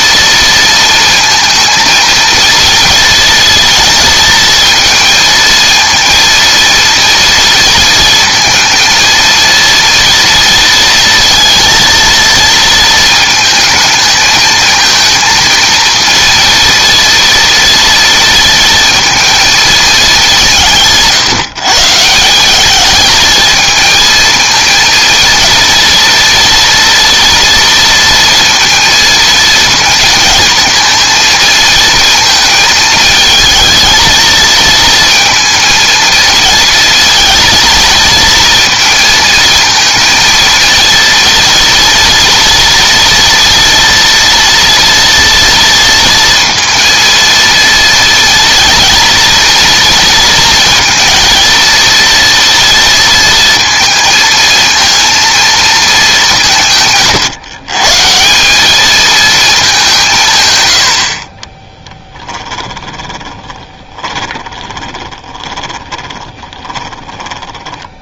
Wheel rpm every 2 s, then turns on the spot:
230, 230, 220, 230, 230, 230, 220, 220, 230, 230, 160, 210, 230, 240, 230, 230, 220, 230, 230, 230, 230, 230, 230, 230, 230, 230, 230, 230, 150, 210, 110, 20, 20, 10.
62-68